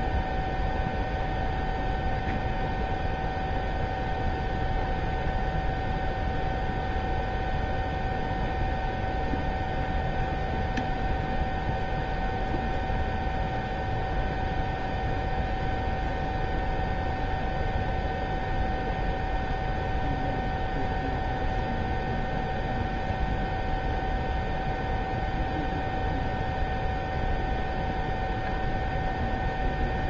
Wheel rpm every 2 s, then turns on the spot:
0, 0, 0, 0, 0, 0, 0, 0, 0, 0, 0, 0, 0, 0, 0.
none